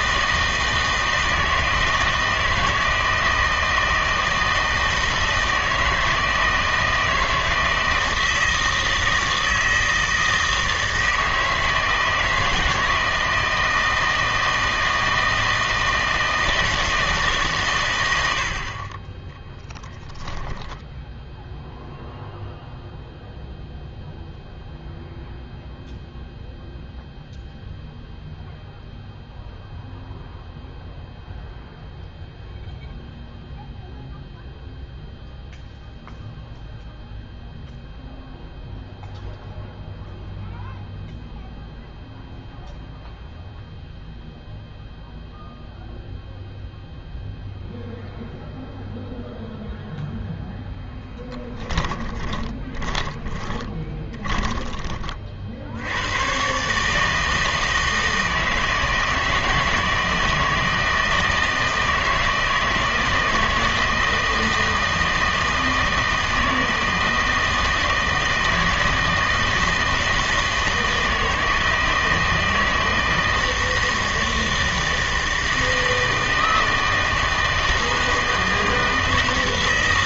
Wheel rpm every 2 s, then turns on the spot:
160, 160, 160, 160, 160, 160, 160, 160, 160, 70, 10, 0, 0, 0, 0, 0, 0, 0, 0, 0, 0, 0, 0, 0, 0, 0, 20, 20, 120, 160, 160, 160, 160, 160, 160, 160, 160, 160, 160, 160.
20-22 52-56